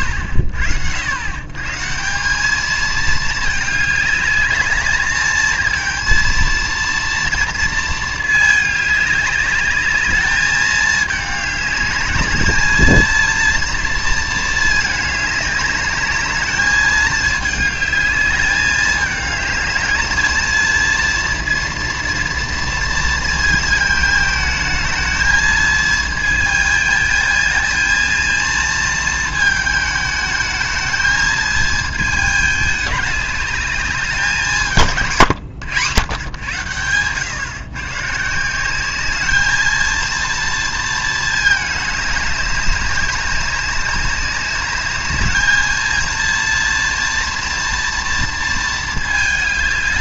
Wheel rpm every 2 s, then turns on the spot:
80, 210, 210, 230, 210, 210, 220, 220, 210, 210, 230, 230, 220, 220, 230, 220, 210, 180, 120, 180, 230, 200, 200, 230, 220.
none